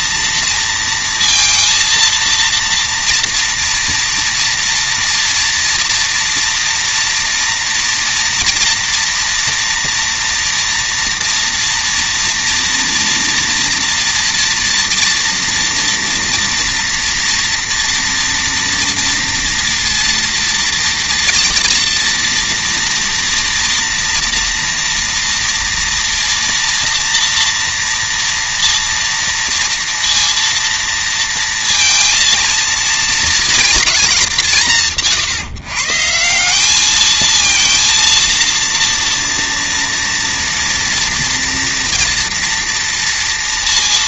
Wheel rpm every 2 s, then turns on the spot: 230, 230, 230, 230, 240, 240, 240, 230, 230, 240, 230, 230, 240, 230, 230, 230, 230, 180, 200, 230, 230, 230.
none